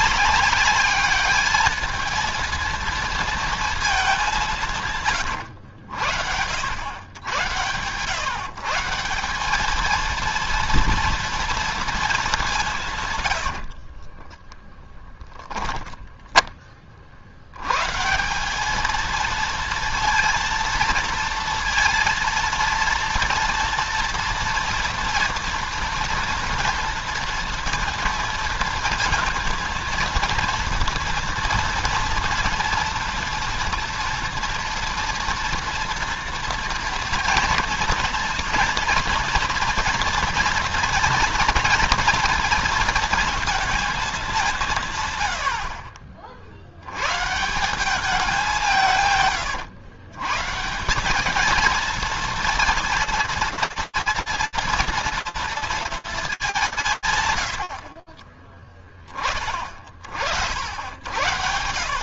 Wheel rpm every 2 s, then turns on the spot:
200, 230, 190, 90, 150, 230, 200, 20, 10, 180, 230, 230, 240, 230, 220, 230, 230, 230, 230, 230, 230, 230, 180, 60, 180, 140, 230, 230, 100, 40, 90.
14-16